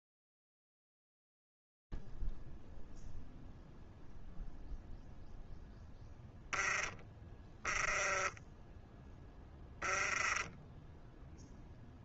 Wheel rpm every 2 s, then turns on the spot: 0, 0, 0, 0, 10, 10.
none